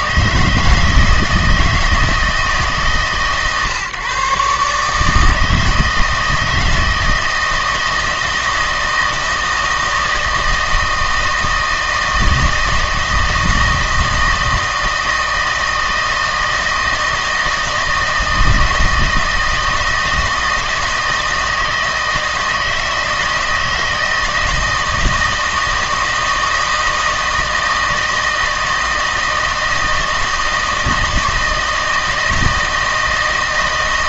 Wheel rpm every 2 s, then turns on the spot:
160, 140, 150, 160, 160, 160, 160, 160, 160, 160, 160, 160, 160, 160, 160, 160, 160.
none